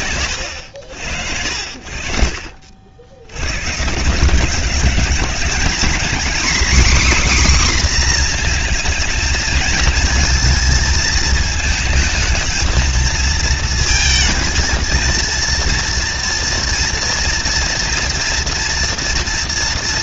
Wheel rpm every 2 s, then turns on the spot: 80, 80, 190, 280, 230, 220, 220, 220, 230, 230.
none